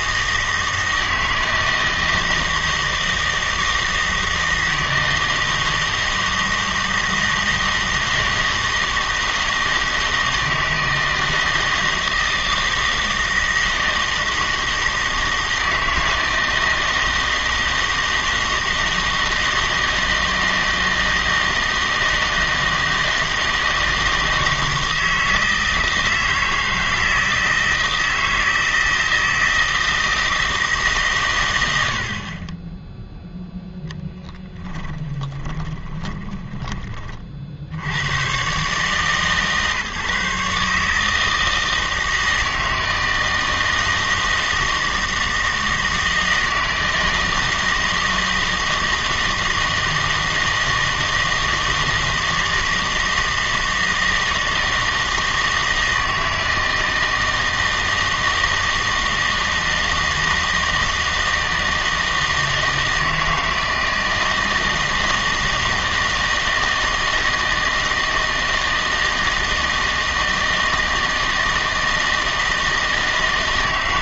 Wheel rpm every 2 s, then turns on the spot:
160, 160, 160, 160, 160, 160, 160, 160, 160, 160, 160, 160, 160, 160, 160, 150, 10, 10, 20, 140, 150, 160, 160, 160, 160, 160, 160, 160, 160, 160, 160, 160, 160, 160, 160, 160, 160.
none